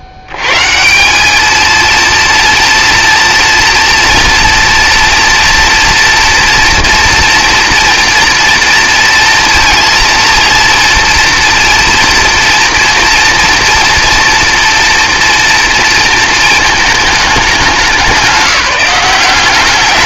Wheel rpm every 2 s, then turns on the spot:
90, 230, 230, 230, 230, 230, 230, 230, 220, 180.
none